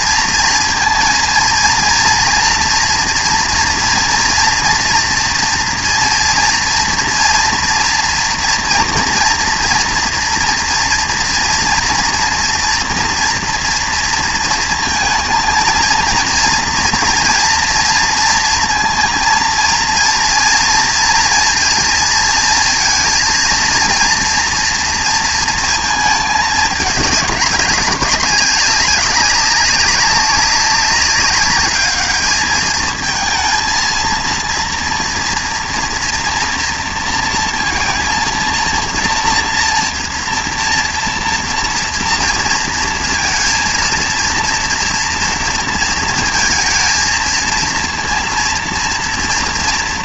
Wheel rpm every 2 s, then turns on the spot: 230, 230, 230, 230, 230, 230, 230, 230, 230, 230, 230, 230, 230, 210, 200, 200, 220, 230, 230, 230, 230, 230, 230, 230, 230.
none